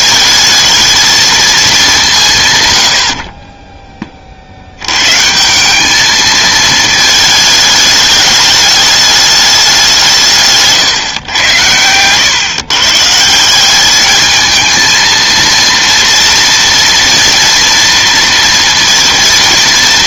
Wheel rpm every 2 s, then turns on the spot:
220, 120, 90, 220, 210, 140, 130, 220, 230, 230.
none